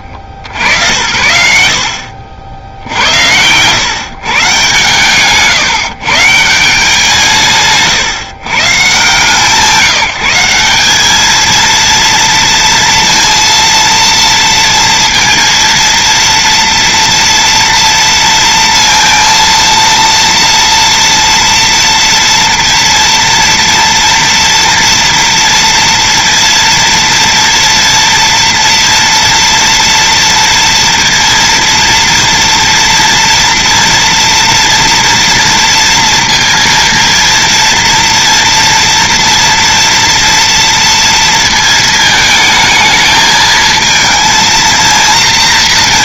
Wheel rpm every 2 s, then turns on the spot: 80, 70, 140, 160, 150, 190, 230, 230, 230, 230, 230, 230, 230, 230, 230, 230, 230, 230, 230, 230, 230, 220, 230.
none